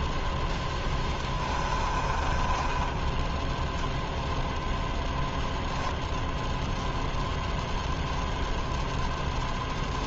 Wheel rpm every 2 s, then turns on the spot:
0, 20, 0, 0, 0.
2-4